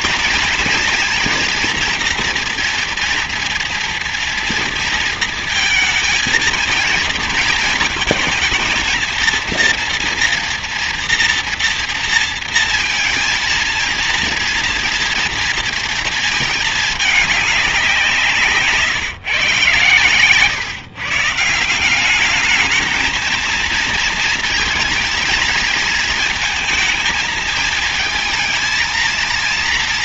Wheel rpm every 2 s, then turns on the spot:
230, 230, 230, 230, 230, 230, 230, 230, 210, 150, 150, 220, 220, 220, 230.
none